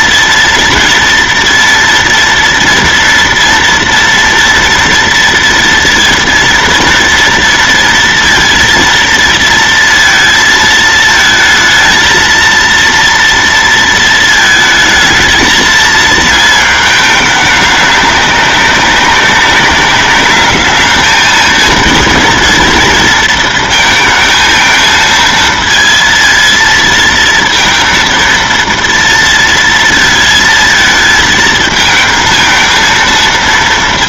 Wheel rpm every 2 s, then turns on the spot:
230, 230, 230, 230, 230, 220, 230, 220, 220, 200, 210, 230, 220, 230, 230, 220, 220.
none